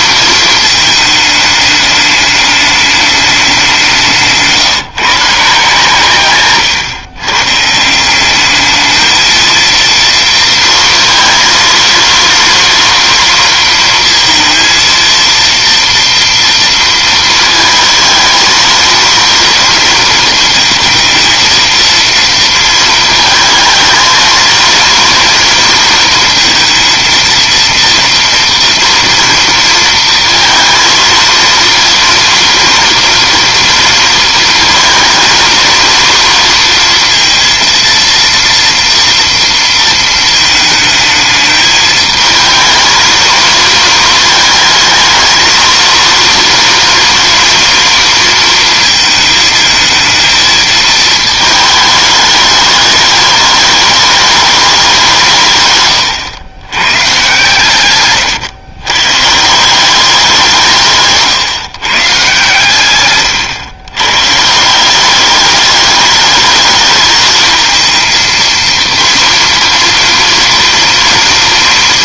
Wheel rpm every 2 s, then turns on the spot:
220, 210, 160, 140, 210, 230, 230, 230, 230, 230, 230, 230, 230, 230, 230, 230, 230, 230, 230, 230, 220, 220, 220, 230, 230, 220, 210, 200, 120, 120, 160, 130, 170, 210, 230, 240.
6-8